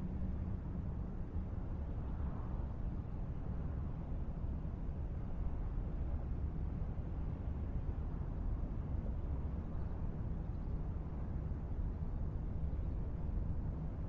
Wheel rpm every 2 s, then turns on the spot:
0, 0, 0, 0, 0, 0, 0.
none